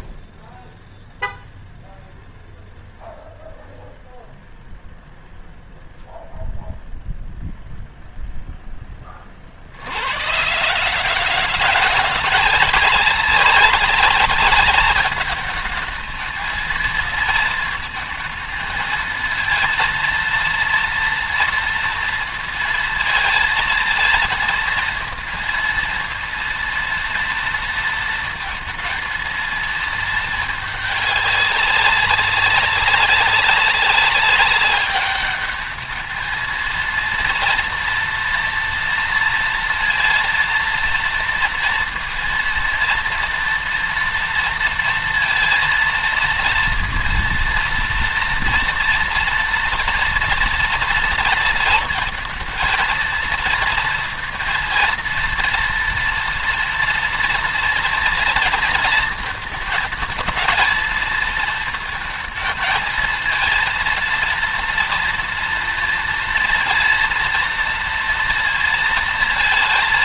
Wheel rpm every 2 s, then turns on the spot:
0, 0, 0, 0, 10, 130, 180, 200, 220, 230, 230, 230, 230, 230, 230, 210, 200, 200, 230, 230, 230, 230, 230, 230, 230, 230, 230, 230, 240, 230, 230, 220, 230, 230, 230.
none